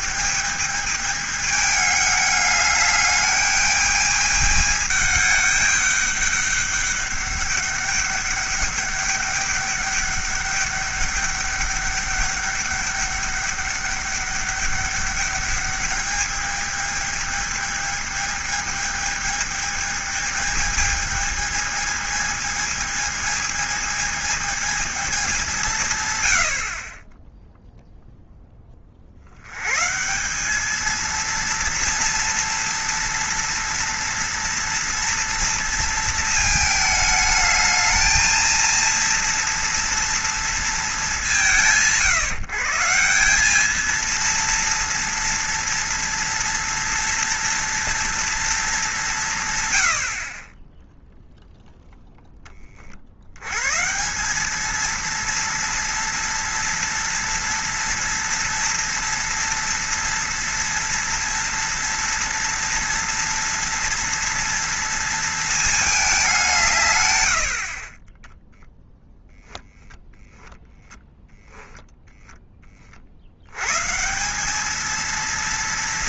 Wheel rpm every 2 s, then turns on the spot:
210, 210, 210, 200, 200, 200, 200, 200, 220, 220, 220, 220, 220, 50, 20, 210, 230, 230, 220, 230, 210, 150, 230, 230, 210, 10, 20, 220, 230, 240, 230, 230, 230, 160, 0, 10, 20, 210.
70-72